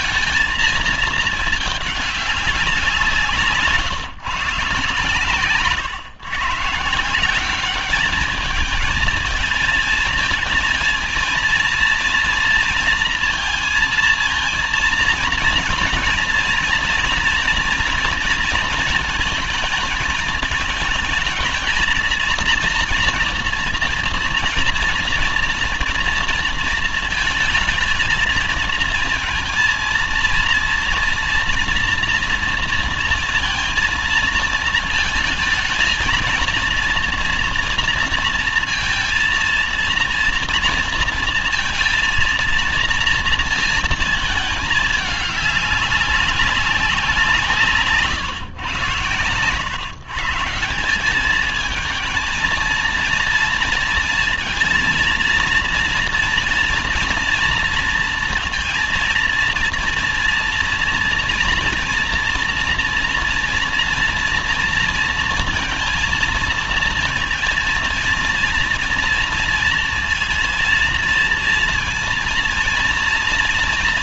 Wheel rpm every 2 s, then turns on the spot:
220, 190, 140, 150, 220, 220, 230, 230, 240, 240, 220, 230, 230, 230, 220, 230, 230, 220, 230, 230, 230, 230, 220, 190, 130, 150, 230, 230, 230, 230, 230, 230, 230, 230, 230, 230, 230.
none